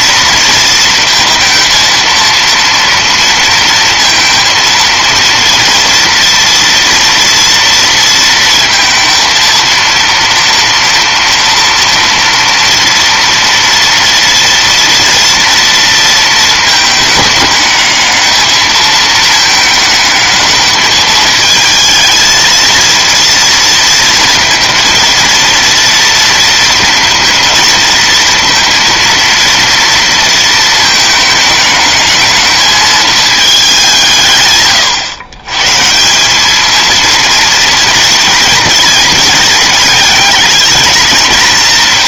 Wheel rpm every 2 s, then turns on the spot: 230, 230, 230, 240, 230, 230, 230, 230, 220, 220, 210, 230, 230, 230, 230, 220, 210, 130, 220, 230, 220.
none